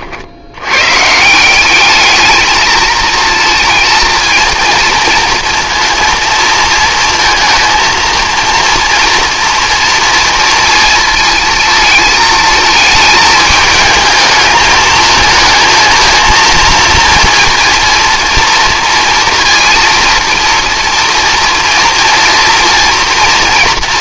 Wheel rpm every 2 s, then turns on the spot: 100, 220, 230, 230, 230, 230, 220, 220, 230, 230, 230, 230.
none